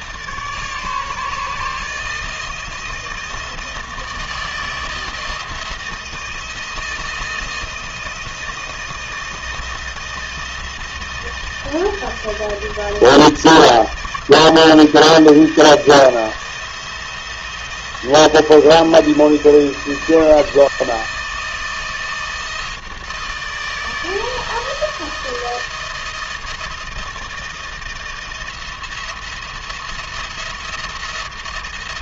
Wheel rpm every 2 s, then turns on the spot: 150, 160, 160, 160, 160, 160, 160, 160, 170, 160, 160, 160, 160, 160, 170, 160.
none